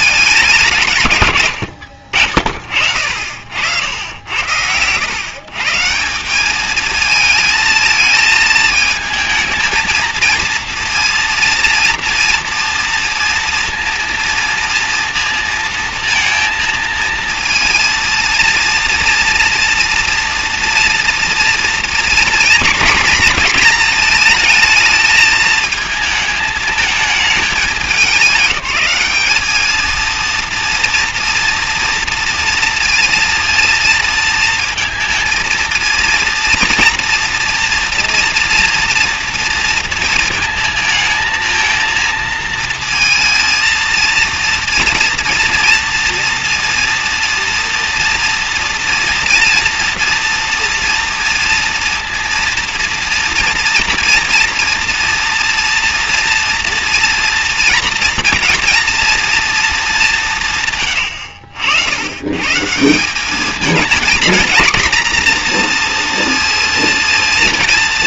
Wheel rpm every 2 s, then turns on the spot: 170, 40, 90, 210, 220, 230, 230, 230, 230, 230, 240, 240, 220, 220, 210, 230, 230, 230, 230, 230, 220, 230, 230, 230, 230, 240, 230, 230, 230, 230, 140, 150, 240, 230.
none